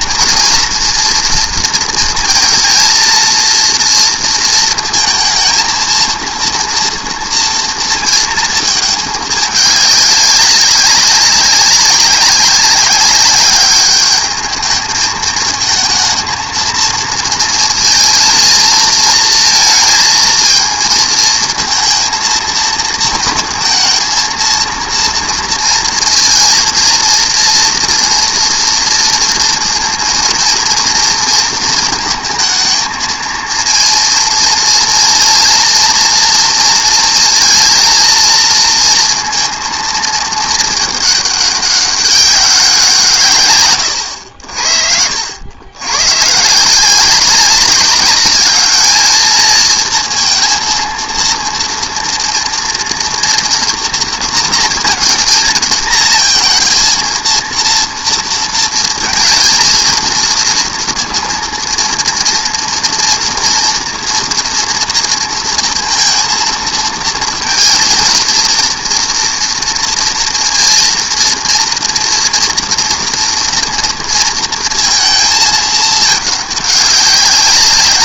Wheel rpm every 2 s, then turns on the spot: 230, 230, 230, 230, 220, 200, 190, 220, 220, 230, 230, 220, 230, 230, 230, 230, 220, 230, 230, 230, 220, 190, 70, 160, 210, 230, 230, 230, 230, 230, 230, 230, 230, 220, 230, 230, 240, 230, 210.
none